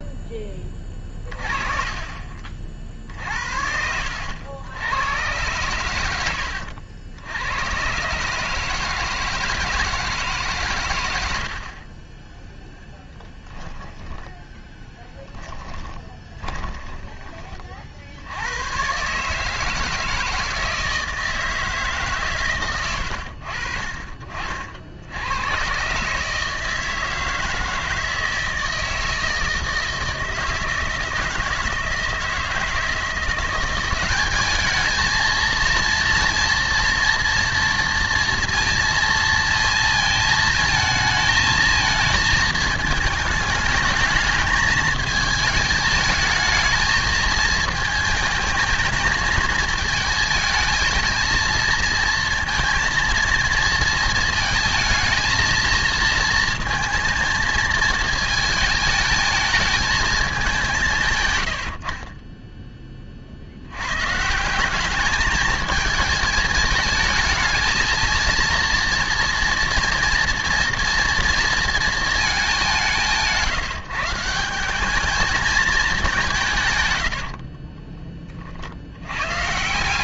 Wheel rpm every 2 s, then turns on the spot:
20, 50, 80, 90, 150, 130, 10, 10, 20, 100, 160, 110, 50, 160, 160, 160, 160, 210, 230, 230, 220, 220, 220, 220, 220, 220, 230, 230, 230, 220, 200, 20, 180, 220, 230, 240, 190, 190, 140, 50.
14-18